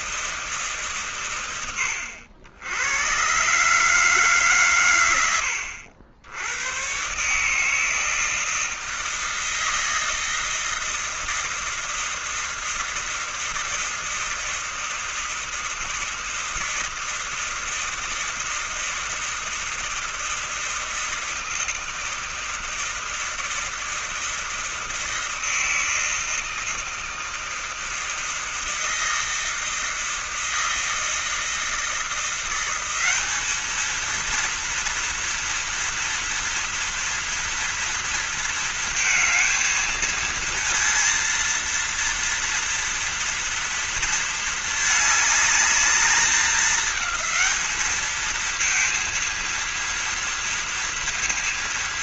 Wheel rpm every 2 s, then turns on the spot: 140, 100, 120, 110, 160, 160, 160, 160, 160, 160, 160, 160, 160, 160, 160, 160, 190, 230, 230, 230, 230, 240, 220, 210, 230, 230.
none